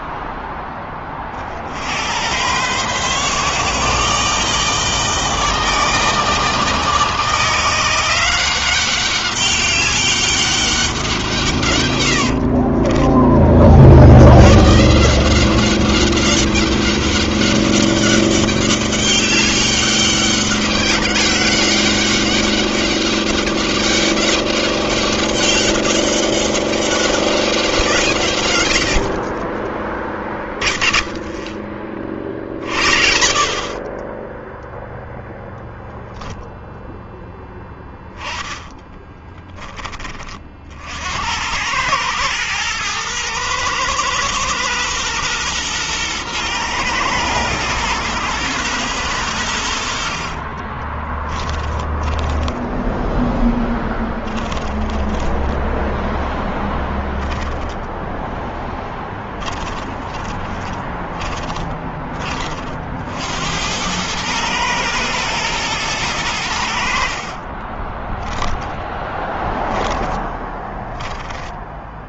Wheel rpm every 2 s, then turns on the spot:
10, 110, 150, 160, 180, 200, 80, 100, 190, 200, 200, 200, 200, 200, 120, 10, 50, 10, 0, 10, 30, 110, 120, 110, 120, 50, 10, 10, 10, 10, 20, 40, 110, 100, 10, 10.
12-14 38-40 50-62 68-72